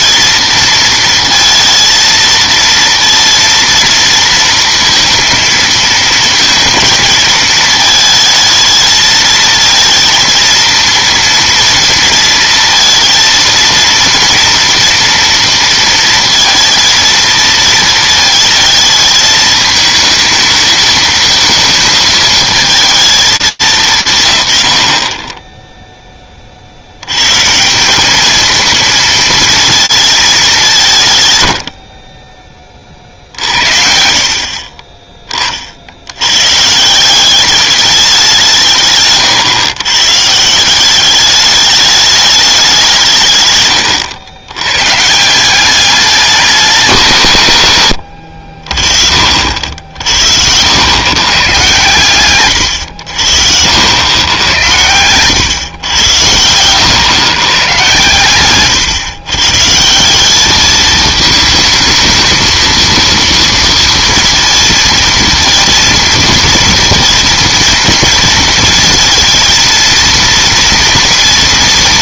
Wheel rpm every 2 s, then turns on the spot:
230, 230, 230, 230, 220, 230, 230, 230, 230, 230, 220, 220, 80, 60, 220, 180, 50, 20, 180, 130, 190, 160, 150, 150, 50, 120, 80, 110, 110, 130, 220, 230, 230, 230, 220, 230.
none